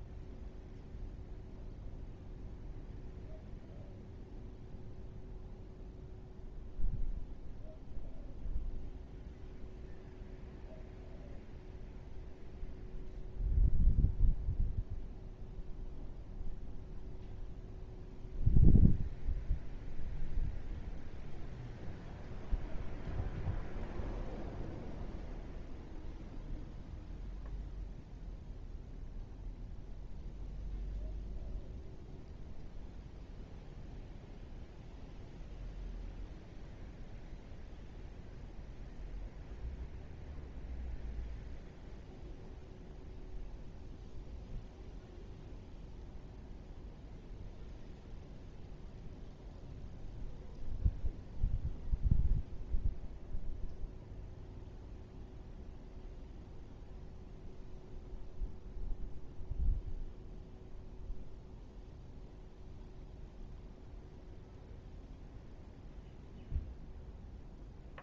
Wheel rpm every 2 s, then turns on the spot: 0, 0, 0, 0, 0, 0, 0, 0, 0, 0, 0, 0, 0, 0, 0, 0, 0, 0, 0, 0, 0, 0, 0, 0, 0, 0, 0, 0, 0, 0, 0, 0, 0, 0.
none